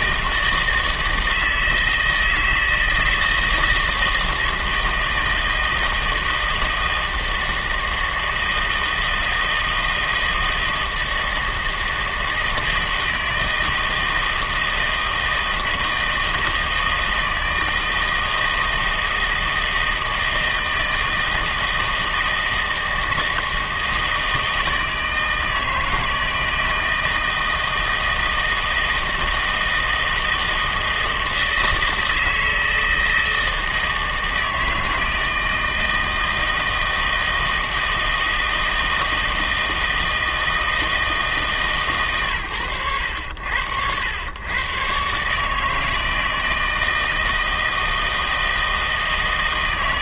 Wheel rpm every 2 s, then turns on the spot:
160, 160, 160, 160, 160, 160, 160, 160, 160, 160, 160, 160, 160, 160, 160, 160, 160, 160, 160, 160, 160, 110, 110, 160, 160.
none